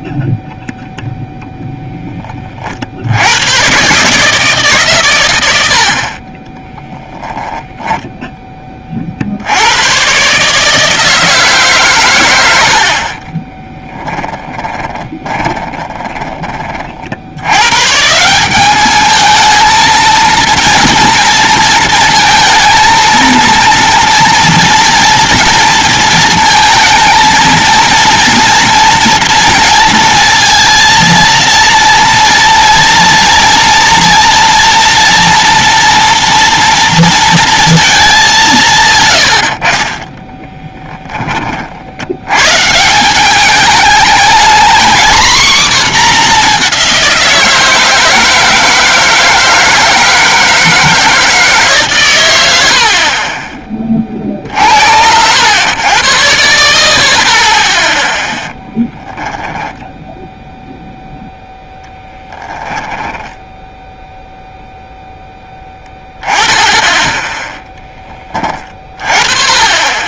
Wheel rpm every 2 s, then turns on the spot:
0, 30, 150, 20, 10, 140, 110, 20, 20, 180, 230, 230, 230, 230, 230, 230, 230, 230, 230, 180, 10, 120, 220, 210, 160, 160, 100, 50, 90, 0, 0, 10, 0, 10, 20.
6-8 14-16 40-42 62-64